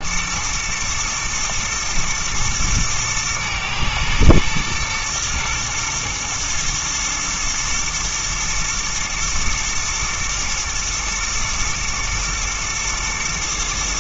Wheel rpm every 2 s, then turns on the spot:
120, 110, 110, 110, 110, 120, 110.
none